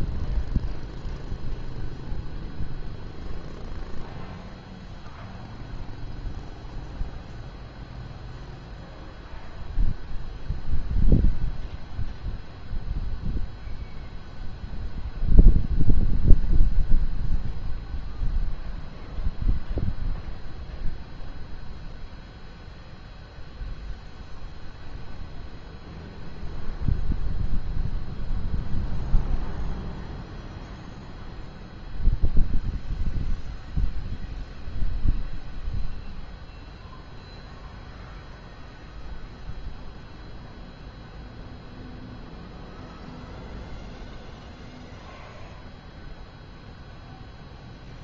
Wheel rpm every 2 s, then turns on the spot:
0, 0, 0, 0, 0, 0, 0, 0, 0, 0, 0, 0, 0, 0, 0, 0, 0, 0, 0, 0, 0, 0, 0, 0.
none